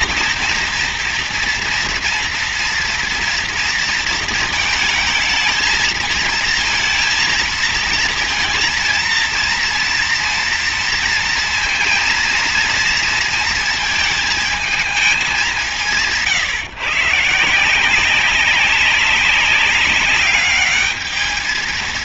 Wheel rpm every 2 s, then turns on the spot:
230, 230, 220, 230, 230, 230, 230, 210, 150, 200, 220.
none